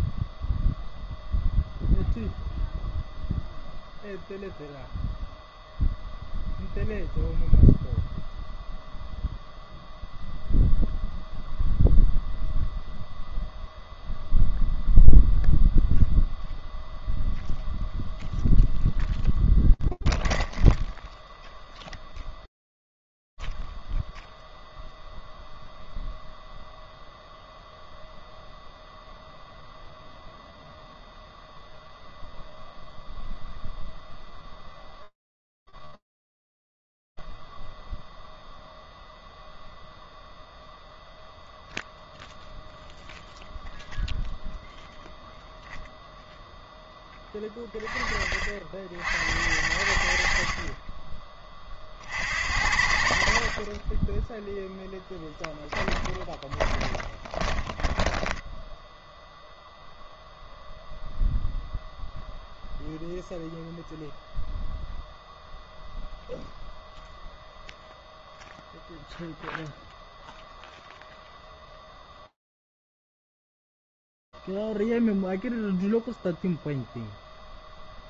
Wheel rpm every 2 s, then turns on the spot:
0, 0, 0, 0, 0, 0, 0, 0, 0, 0, 0, 0, 0, 0, 0, 0, 0, 0, 0, 0, 0, 0, 0, 20, 70, 30, 40, 20, 20, 0, 0, 0, 0, 0, 0, 0, 0, 0, 0.
52-58